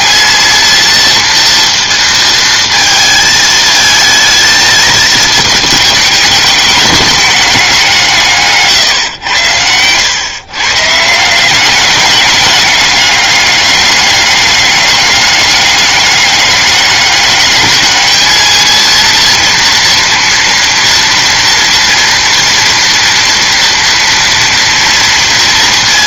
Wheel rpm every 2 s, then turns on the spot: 230, 230, 220, 210, 140, 120, 200, 200, 200, 220, 230, 230, 230.
8-10